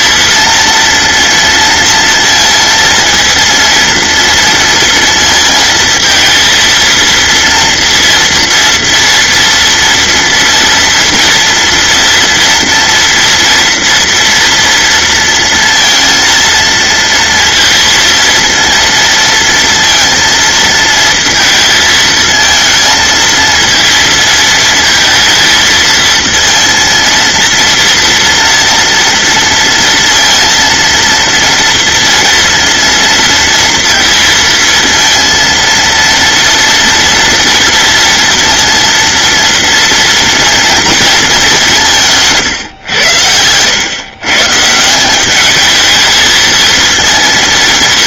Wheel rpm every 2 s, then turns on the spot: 230, 230, 230, 230, 230, 230, 230, 240, 230, 230, 230, 230, 230, 220, 230, 230, 230, 230, 230, 230, 230, 210, 100, 210.
none